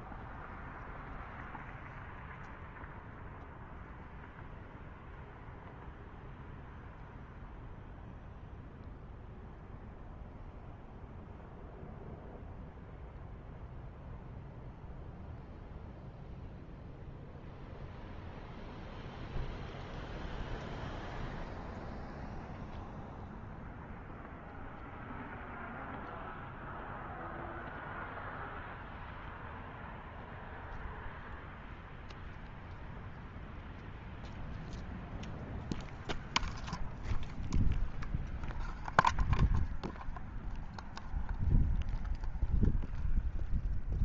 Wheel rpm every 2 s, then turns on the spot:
0, 0, 0, 0, 0, 0, 0, 0, 0, 0, 0, 0, 0, 0, 0, 0, 0, 0, 0, 0, 0, 0.
none